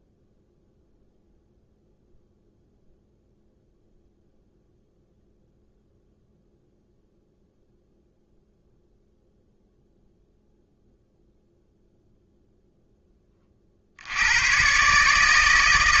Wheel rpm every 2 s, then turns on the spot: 0, 0, 0, 0, 0, 0, 0, 130.
none